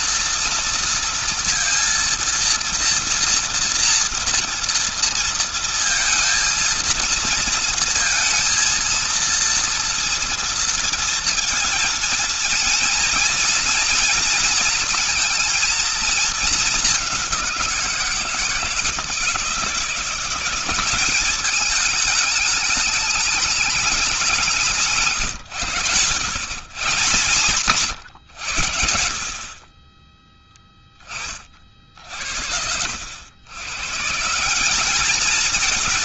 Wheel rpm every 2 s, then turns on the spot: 230, 230, 230, 230, 230, 230, 230, 230, 210, 160, 190, 210, 160, 130, 80, 10, 70, 200.
none